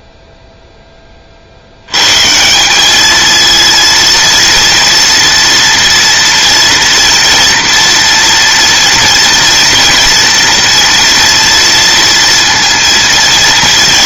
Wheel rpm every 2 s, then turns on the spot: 10, 200, 230, 230, 230, 230, 230.
none